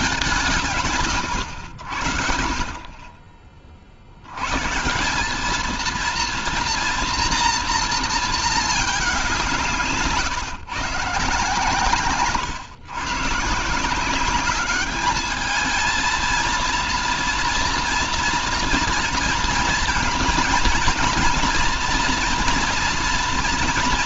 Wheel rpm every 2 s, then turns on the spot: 180, 50, 120, 230, 220, 150, 130, 200, 230, 240, 230, 230.
none